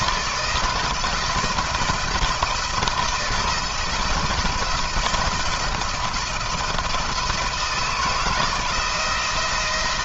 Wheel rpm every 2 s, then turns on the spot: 170, 170, 160, 170, 170.
none